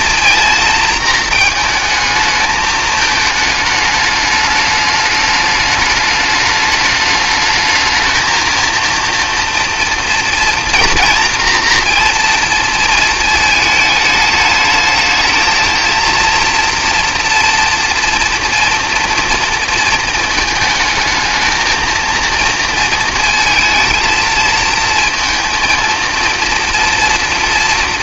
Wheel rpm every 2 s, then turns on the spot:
230, 220, 210, 210, 230, 240, 220, 220, 240, 240, 220, 230, 230, 230.
none